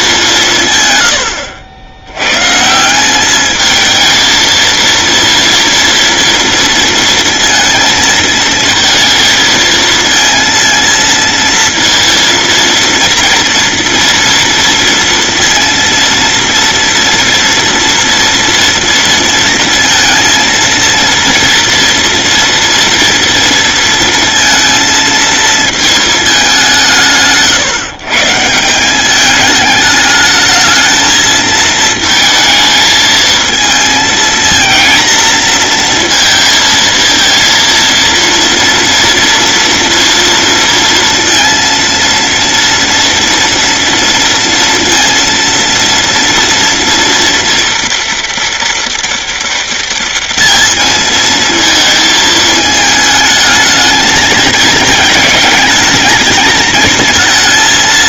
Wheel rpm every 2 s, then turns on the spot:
150, 140, 230, 230, 230, 230, 240, 230, 230, 230, 230, 230, 230, 190, 170, 220, 220, 230, 230, 230, 230, 230, 230, 230, 230, 220, 220, 220, 220.
none